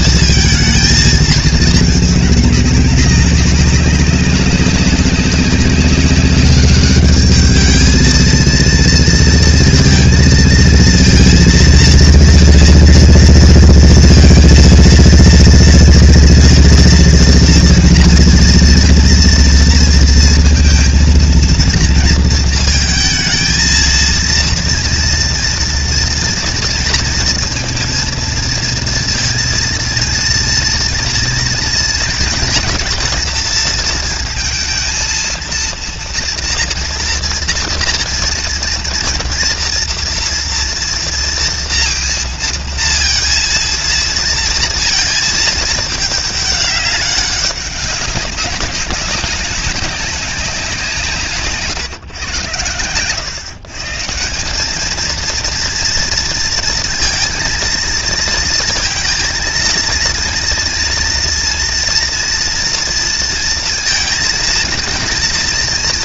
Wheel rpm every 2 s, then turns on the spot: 220, 210, 200, 200, 230, 230, 230, 230, 230, 230, 230, 230, 230, 230, 230, 230, 230, 230, 240, 230, 230, 230, 230, 200, 190, 190, 120, 190, 230, 230, 230, 230, 220.
none